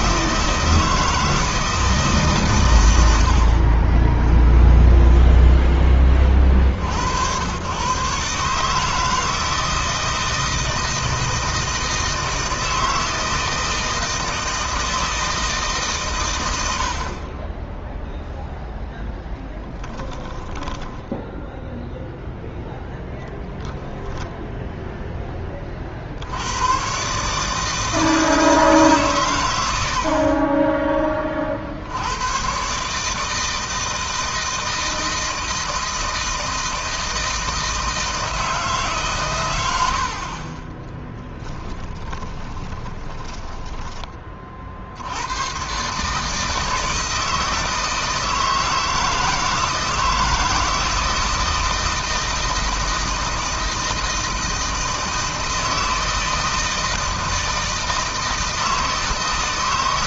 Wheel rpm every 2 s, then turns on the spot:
160, 100, 10, 70, 150, 160, 160, 160, 70, 0, 10, 0, 10, 130, 140, 20, 150, 160, 160, 140, 10, 20, 70, 160, 160, 170, 160, 160, 160, 160.
4-6 20-22 40-44